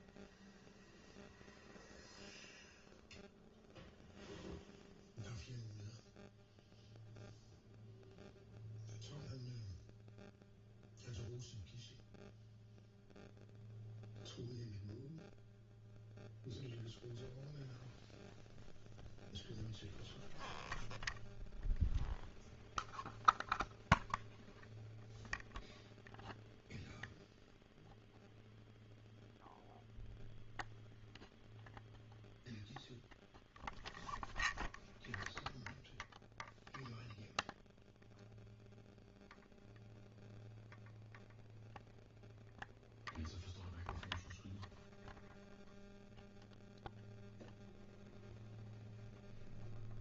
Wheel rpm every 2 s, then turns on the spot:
0, 0, 0, 0, 0, 0, 0, 0, 0, 0, 0, 0, 0, 0, 0, 0, 0, 0, 0, 0, 0, 0, 0, 0, 0.
none